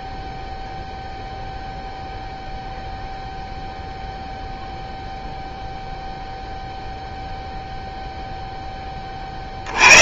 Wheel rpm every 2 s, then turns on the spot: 0, 0, 0, 0, 10.
none